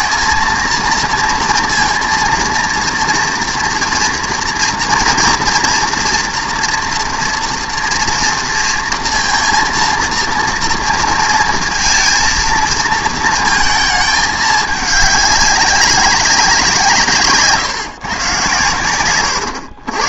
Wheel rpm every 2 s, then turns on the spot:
230, 230, 230, 240, 230, 230, 230, 210, 180, 110.
none